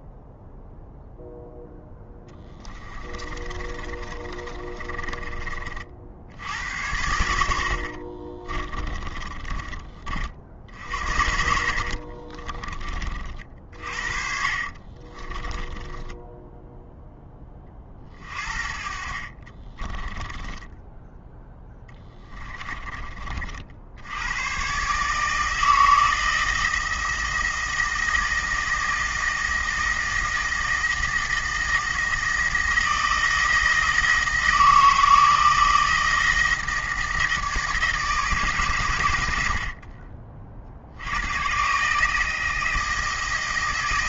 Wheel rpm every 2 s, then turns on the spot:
0, 20, 30, 90, 20, 60, 30, 40, 10, 50, 10, 20, 130, 160, 160, 160, 160, 160, 160, 140, 60, 160.
2-6 8-10 14-16 20-22